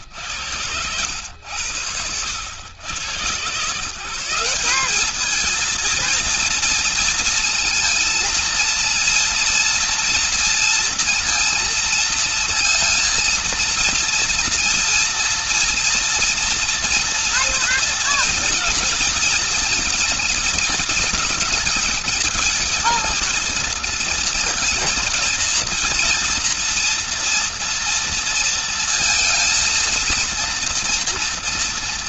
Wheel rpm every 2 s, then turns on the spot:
90, 100, 190, 230, 230, 230, 230, 230, 230, 230, 210, 220, 230, 230, 230, 230.
none